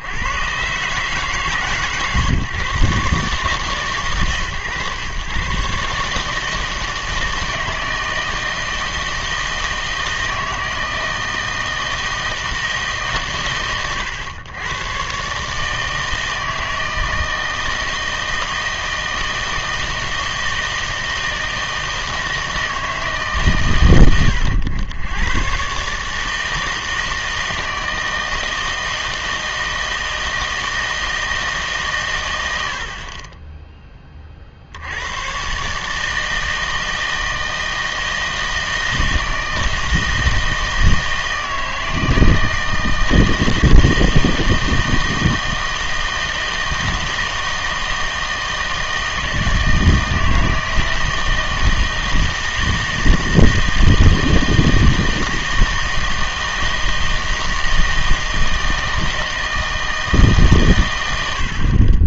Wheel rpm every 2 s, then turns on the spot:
140, 130, 130, 160, 160, 160, 160, 120, 160, 160, 160, 160, 90, 160, 160, 160, 80, 70, 160, 160, 160, 160, 160, 160, 160, 160, 160, 160, 160, 160, 120.
none